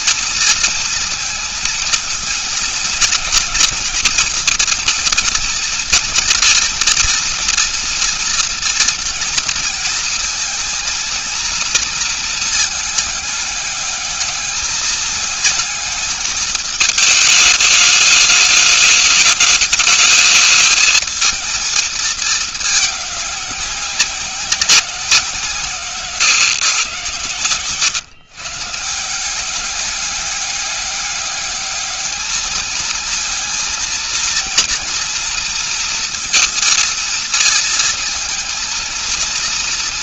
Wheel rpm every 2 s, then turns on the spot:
230, 230, 230, 230, 240, 230, 230, 210, 220, 210, 220, 220, 190, 130, 140, 200, 220, 230, 230, 220.
none